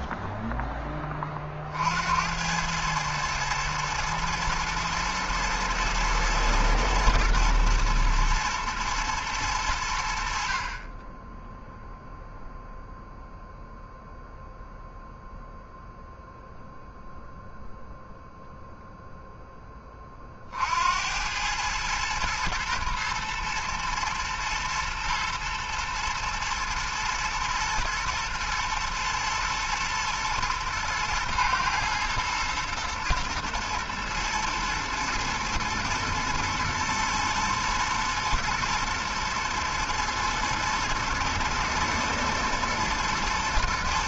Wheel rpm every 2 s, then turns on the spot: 10, 100, 110, 110, 110, 40, 0, 0, 0, 0, 60, 110, 120, 110, 120, 110, 120, 110, 110, 120, 120, 120.
none